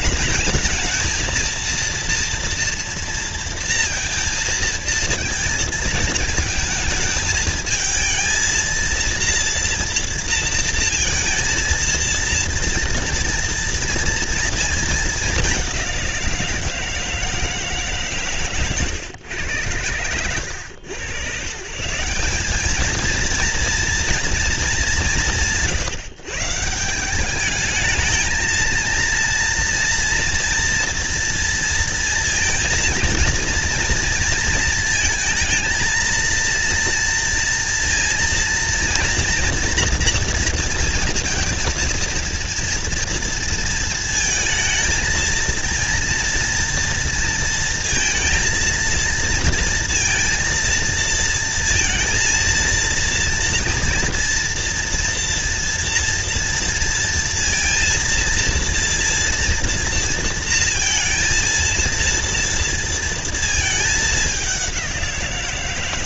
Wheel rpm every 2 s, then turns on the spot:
220, 230, 230, 230, 230, 230, 230, 220, 170, 130, 110, 200, 200, 150, 220, 230, 230, 230, 230, 230, 230, 230, 230, 230, 230, 230, 230, 230, 230, 230, 230, 240, 200.
none